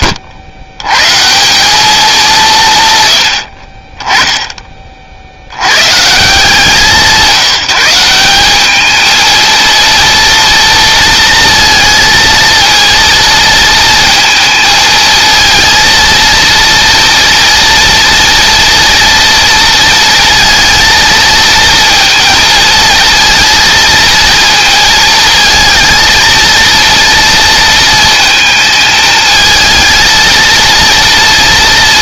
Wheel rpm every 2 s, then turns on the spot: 120, 130, 30, 170, 220, 230, 230, 220, 230, 240, 230, 230, 220, 230, 220, 230.
none